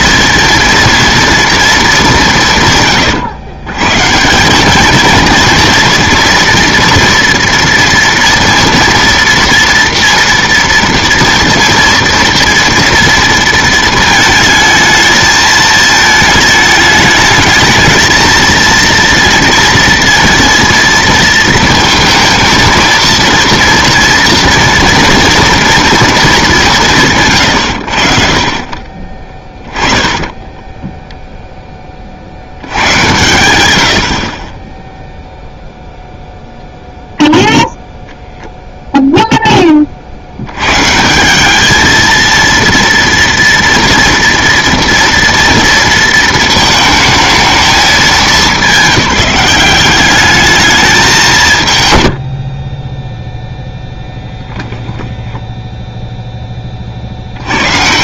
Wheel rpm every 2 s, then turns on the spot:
230, 150, 200, 230, 230, 230, 230, 220, 210, 230, 230, 230, 230, 190, 40, 10, 100, 20, 0, 0, 120, 230, 230, 220, 190, 210, 40, 0, 30.
30-32 52-54